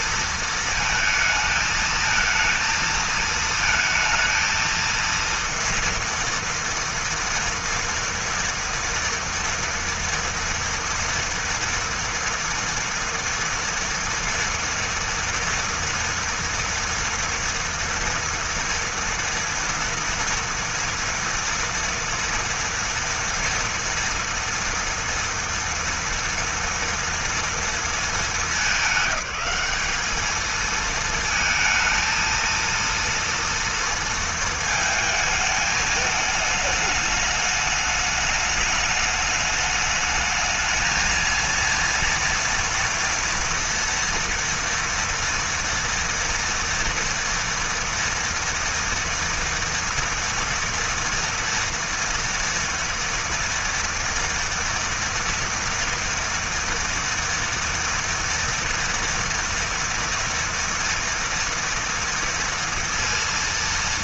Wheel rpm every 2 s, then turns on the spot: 230, 220, 230, 240, 230, 230, 230, 230, 230, 230, 230, 230, 230, 230, 210, 220, 230, 220, 210, 210, 220, 230, 230, 230, 230, 230, 230, 230, 230, 230, 230, 230.
none